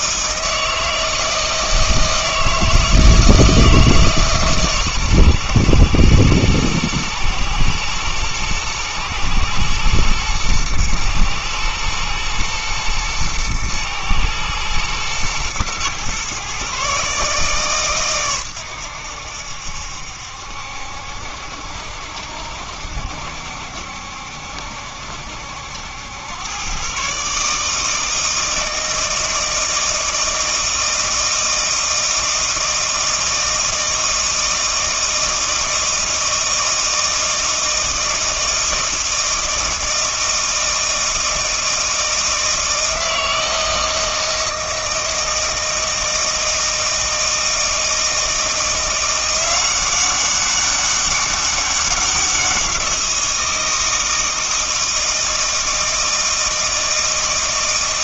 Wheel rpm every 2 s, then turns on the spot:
160, 160, 140, 110, 110, 120, 120, 110, 130, 100, 70, 70, 70, 120, 160, 160, 160, 160, 160, 160, 160, 160, 160, 160, 170, 200, 180, 160, 160.
none